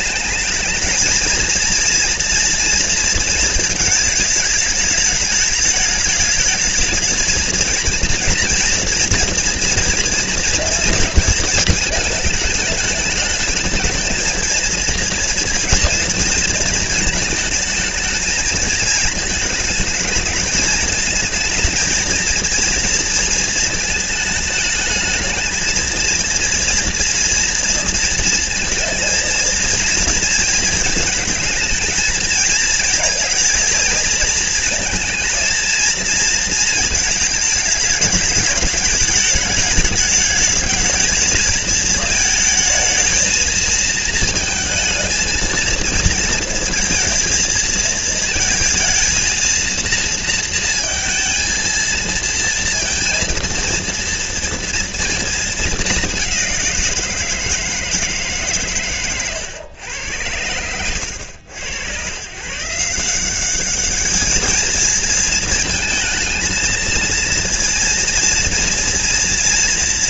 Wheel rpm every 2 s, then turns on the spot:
220, 230, 210, 220, 230, 230, 210, 230, 220, 220, 220, 230, 220, 240, 230, 220, 220, 230, 220, 210, 220, 220, 220, 230, 230, 230, 230, 230, 170, 120, 110, 170, 220, 230, 230.
none